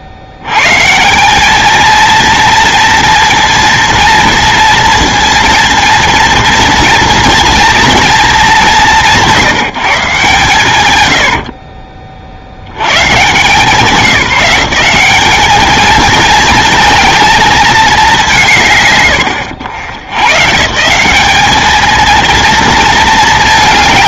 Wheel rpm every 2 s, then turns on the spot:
100, 230, 230, 230, 180, 120, 80, 180, 230, 190, 170, 230.
none